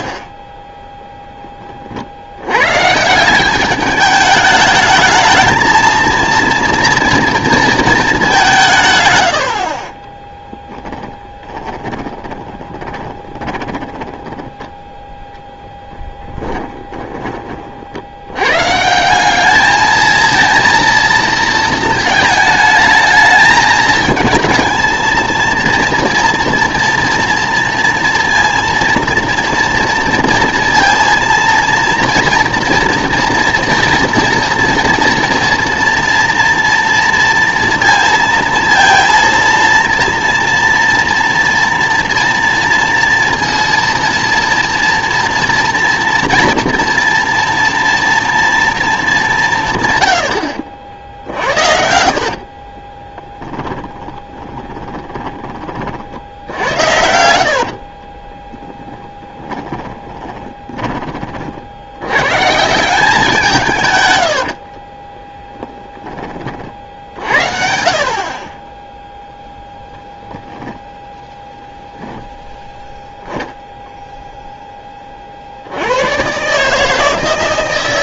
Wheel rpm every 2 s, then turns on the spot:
10, 120, 220, 230, 150, 20, 20, 10, 10, 130, 230, 220, 220, 230, 230, 230, 240, 230, 230, 230, 230, 230, 230, 230, 230, 70, 40, 30, 70, 20, 30, 170, 40, 40, 10, 10, 10, 10, 150.
0-2 12-14 16-18 50-62 64-66